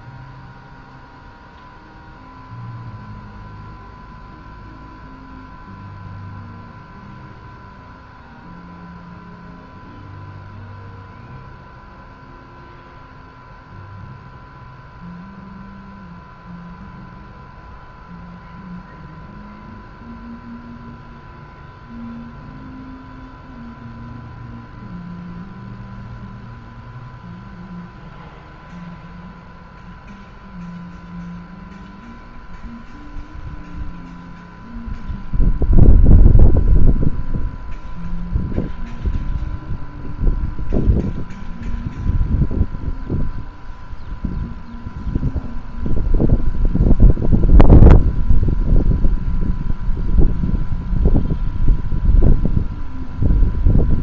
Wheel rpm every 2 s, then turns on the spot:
0, 0, 0, 0, 0, 0, 0, 0, 0, 0, 0, 0, 0, 0, 0, 0, 0, 0, 0, 0, 0, 0, 0, 0, 0, 0, 0.
none